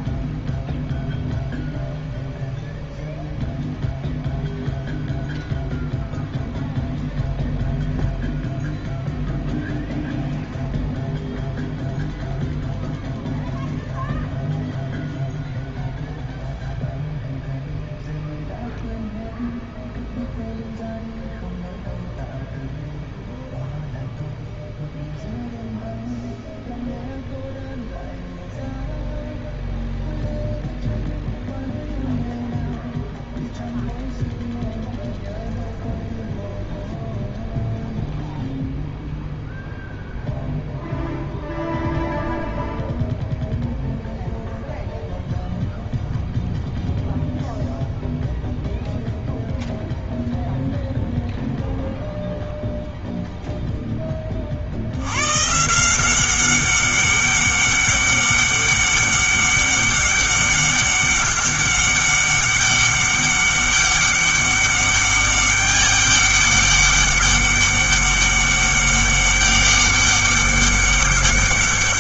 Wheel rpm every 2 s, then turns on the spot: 0, 0, 0, 0, 0, 0, 0, 0, 0, 0, 0, 0, 0, 0, 0, 0, 0, 0, 0, 0, 0, 0, 0, 0, 0, 0, 0, 60, 190, 200, 200, 200, 200, 200, 200, 200.
none